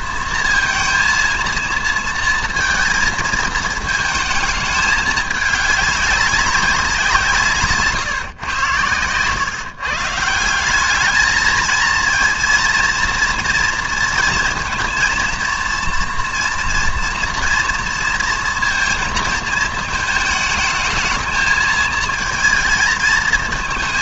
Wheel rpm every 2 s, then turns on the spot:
230, 230, 220, 190, 120, 190, 230, 230, 230, 230, 210, 220.
none